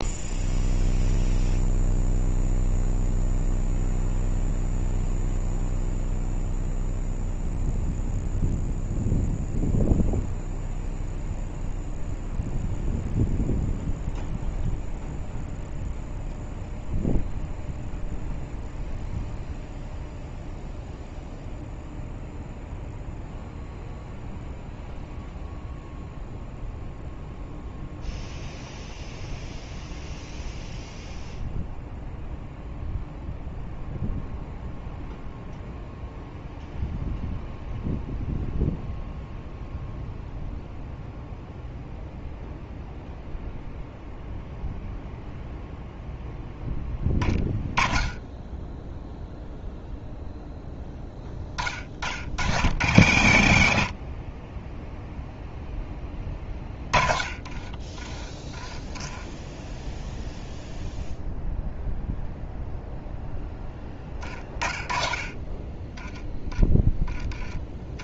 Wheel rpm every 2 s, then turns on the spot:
0, 0, 0, 0, 0, 0, 0, 0, 0, 0, 0, 0, 0, 0, 0, 0, 0, 0, 0, 0, 0, 0, 0, 10, 10, 0, 80, 0, 30, 10, 0, 0, 20, 10.
56-58